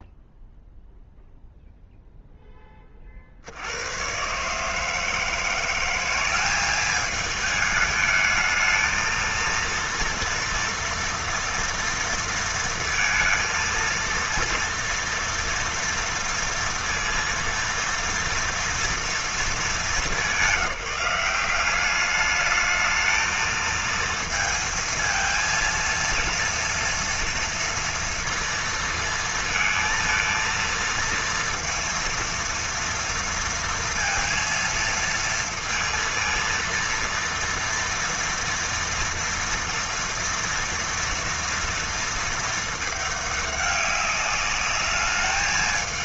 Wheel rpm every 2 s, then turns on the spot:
0, 40, 160, 210, 230, 240, 230, 230, 230, 220, 190, 220, 230, 230, 230, 230, 230, 230, 230, 230, 230, 210, 210.
none